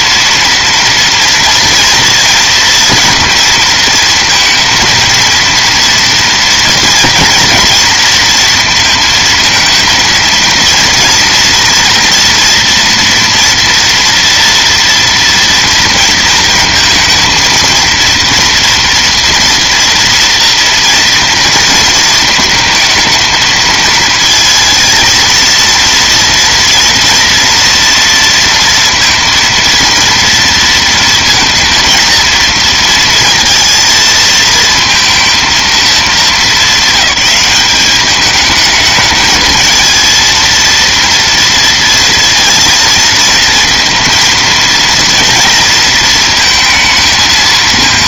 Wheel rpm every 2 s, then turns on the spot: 230, 230, 230, 230, 230, 230, 230, 240, 230, 240, 230, 220, 230, 230, 230, 230, 230, 230, 200, 210, 230, 220, 230, 220.
none